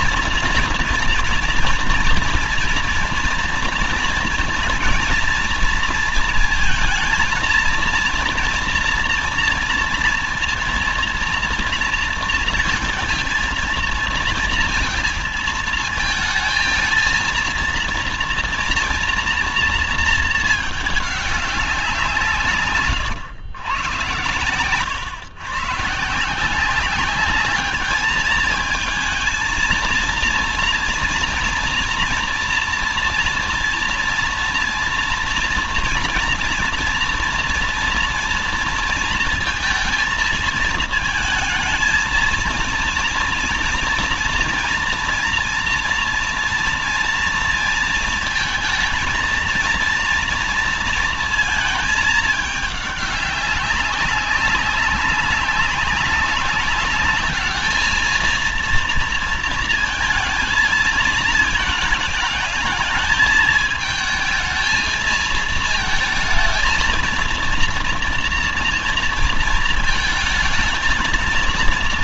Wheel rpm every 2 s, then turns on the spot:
230, 240, 230, 230, 240, 230, 230, 230, 220, 230, 210, 120, 120, 180, 220, 230, 230, 240, 230, 230, 220, 230, 230, 230, 230, 230, 210, 200, 210, 230, 220, 210, 220, 230, 230, 220.
none